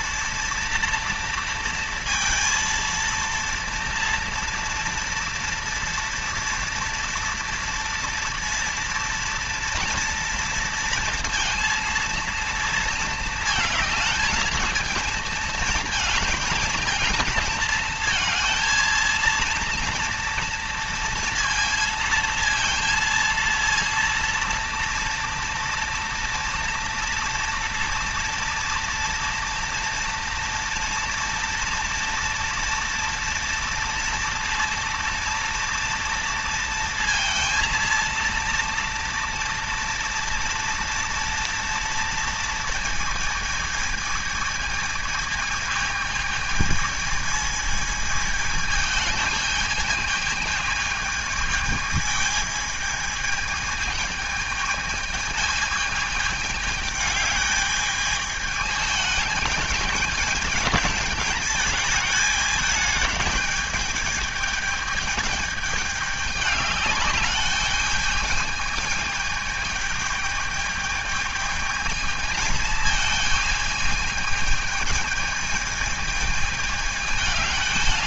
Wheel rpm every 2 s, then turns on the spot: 230, 230, 230, 230, 230, 230, 230, 220, 220, 230, 230, 230, 240, 240, 230, 230, 230, 230, 230, 230, 230, 230, 220, 220, 220, 220, 220, 220, 210, 220, 220, 220, 220, 200, 220, 220, 220, 220, 210.
none